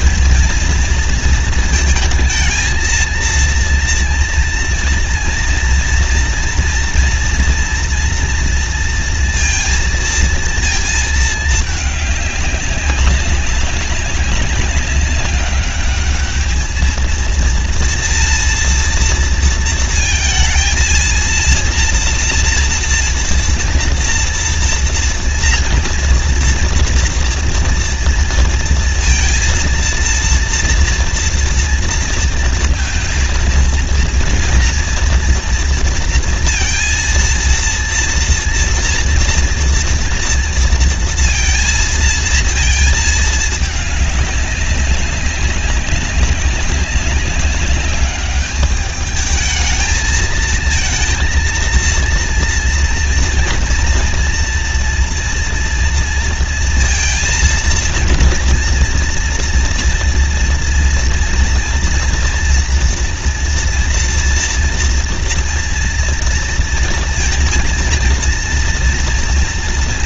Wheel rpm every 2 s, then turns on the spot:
230, 220, 230, 240, 230, 230, 200, 200, 220, 230, 230, 230, 230, 230, 230, 230, 230, 230, 230, 230, 230, 230, 200, 190, 210, 220, 230, 240, 230, 230, 240, 230, 230, 230, 230.
none